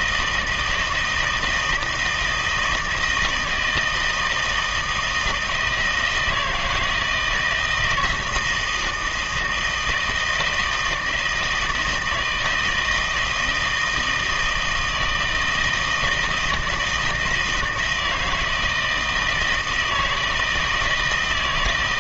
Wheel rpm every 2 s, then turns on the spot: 160, 160, 160, 170, 160, 160, 160, 160, 160, 160, 160.
none